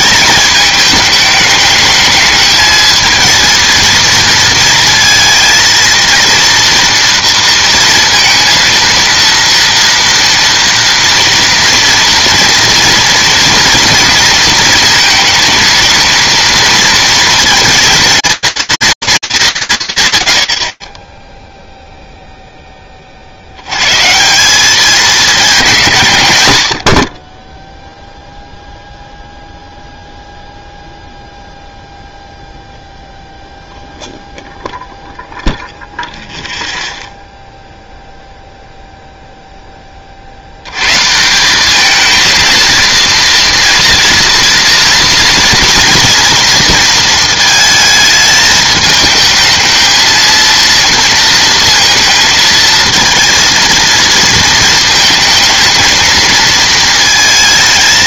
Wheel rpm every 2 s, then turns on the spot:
210, 220, 230, 230, 230, 230, 230, 230, 230, 230, 60, 20, 200, 70, 0, 0, 0, 0, 0, 0, 150, 230, 230, 230, 220, 230, 230, 220, 220.
none